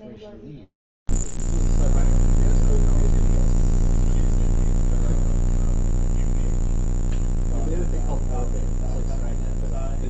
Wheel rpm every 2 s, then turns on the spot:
0, 0, 0, 0, 0.
none